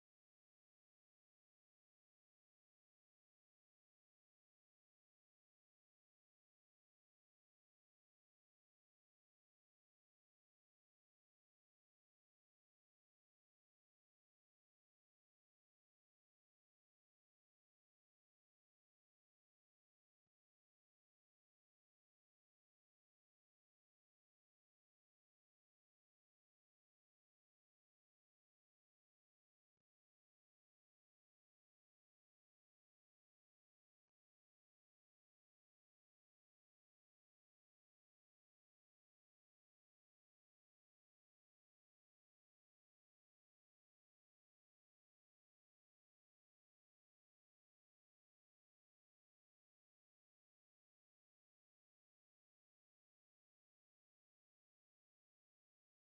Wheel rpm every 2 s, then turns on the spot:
0, 0, 0, 0, 0, 0, 0, 0, 0, 0, 0, 0, 0, 0, 0, 0, 0, 0, 0, 0, 0, 0, 0, 0, 0, 0, 0, 0.
none